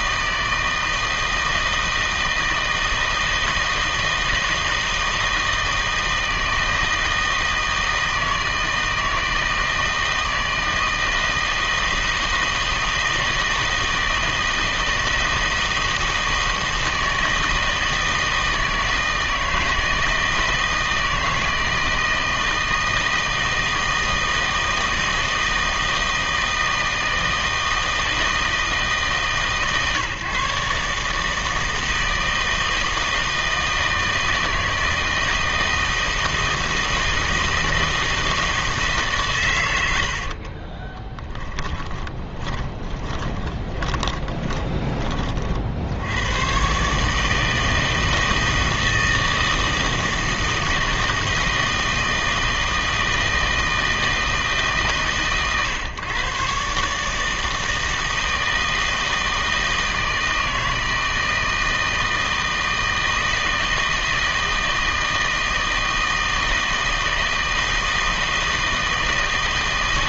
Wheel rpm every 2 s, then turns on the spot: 160, 160, 160, 160, 160, 160, 160, 160, 160, 160, 160, 160, 160, 160, 160, 140, 160, 160, 160, 160, 20, 20, 20, 130, 160, 160, 160, 150, 140, 160, 160, 160, 160, 160, 160.
40-46